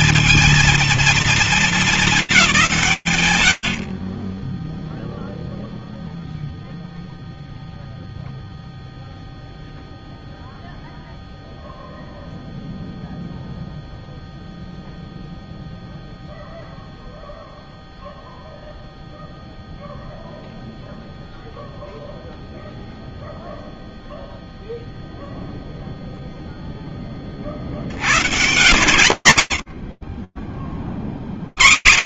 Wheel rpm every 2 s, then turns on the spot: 230, 160, 0, 0, 0, 0, 0, 0, 0, 0, 0, 0, 0, 100, 80, 20.
none